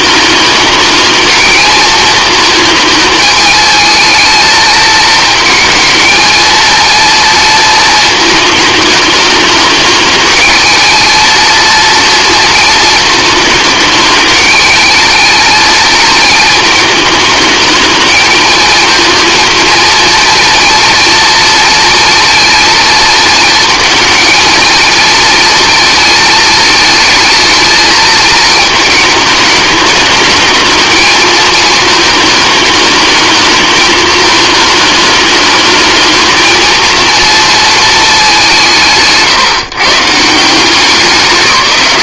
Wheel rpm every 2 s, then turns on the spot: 220, 220, 220, 230, 210, 220, 220, 220, 220, 230, 230, 230, 220, 220, 220, 220, 220, 210, 230, 170, 170.
none